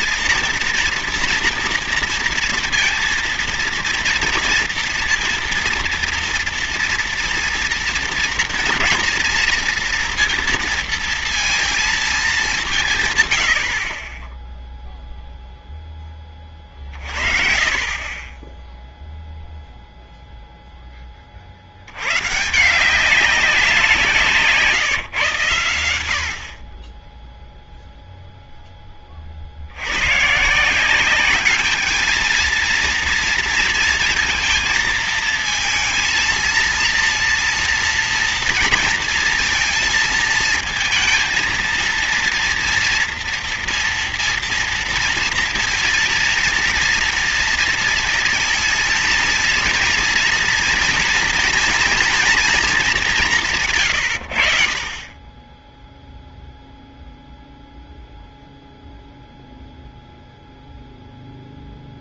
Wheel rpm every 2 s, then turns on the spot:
240, 230, 230, 230, 230, 230, 160, 0, 30, 10, 10, 170, 140, 20, 20, 180, 230, 220, 230, 230, 220, 230, 230, 230, 230, 230, 200, 40, 0, 0, 0.
none